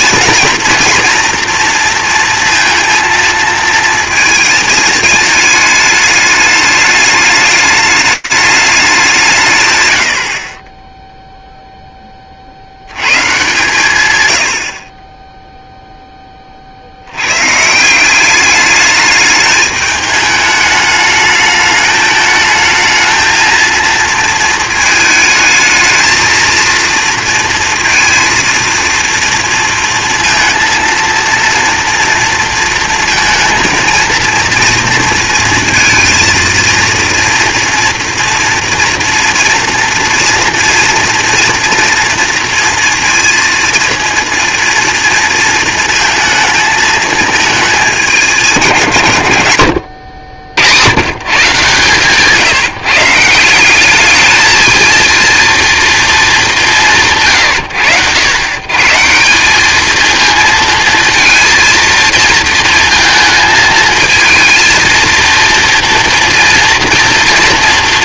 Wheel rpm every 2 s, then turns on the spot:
230, 230, 220, 210, 190, 10, 120, 30, 80, 210, 210, 220, 220, 230, 230, 230, 230, 230, 230, 240, 230, 230, 230, 220, 140, 120, 160, 220, 100, 150, 230, 230, 230, 230.
none